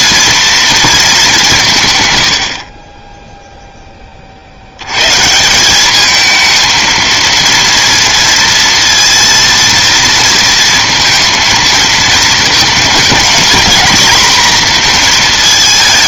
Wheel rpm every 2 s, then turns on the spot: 230, 80, 70, 220, 230, 230, 220, 240.
none